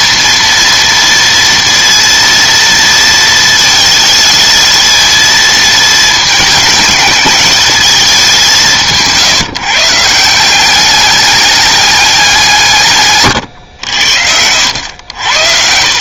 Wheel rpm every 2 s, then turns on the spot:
230, 230, 220, 220, 190, 180, 170, 80.
none